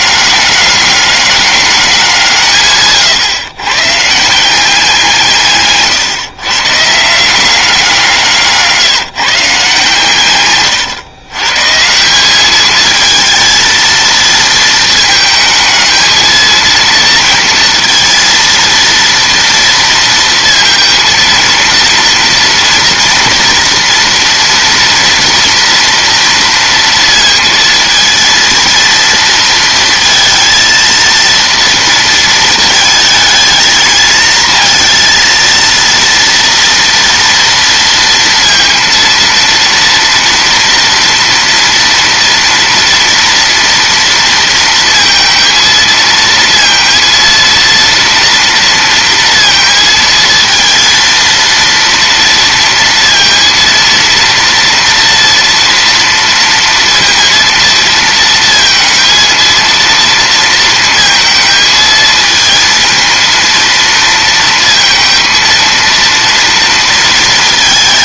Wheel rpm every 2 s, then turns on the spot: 200, 140, 180, 130, 170, 130, 210, 220, 230, 230, 230, 230, 230, 230, 230, 230, 220, 230, 230, 230, 230, 230, 230, 230, 230, 230, 230, 230, 230, 230, 220, 230, 230, 230.
8-12